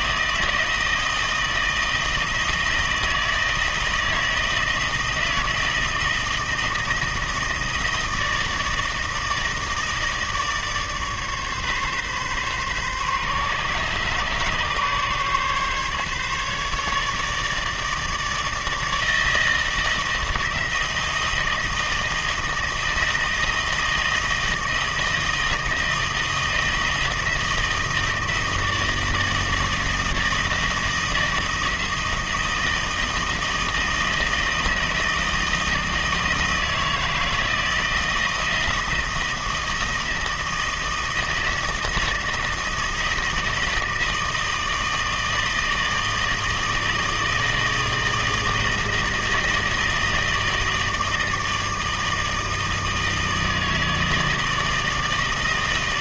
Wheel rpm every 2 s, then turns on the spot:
160, 160, 160, 160, 160, 160, 140, 140, 150, 160, 160, 160, 160, 160, 160, 160, 160, 160, 160, 160, 170, 160, 160, 160, 160, 160, 160, 160.
none